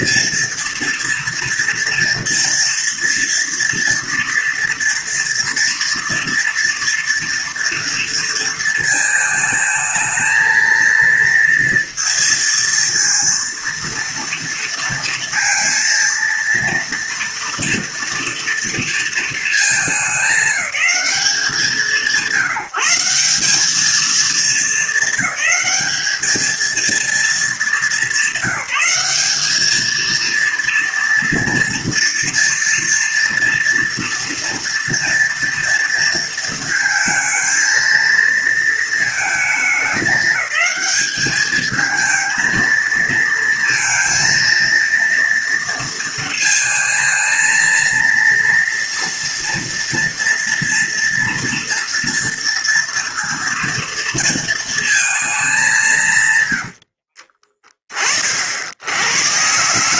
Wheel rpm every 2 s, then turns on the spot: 230, 240, 230, 230, 230, 230, 230, 230, 230, 230, 210, 160, 220, 220, 210, 230, 230, 230, 220, 230, 210, 230, 230, 220, 230, 230, 230, 230, 100, 60.
56-58